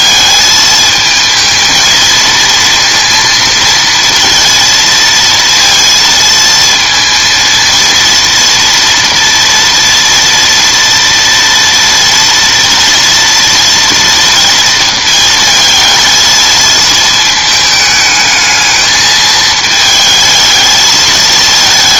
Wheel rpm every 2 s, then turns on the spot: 220, 230, 230, 230, 230, 230, 230, 220, 220, 220, 220.
none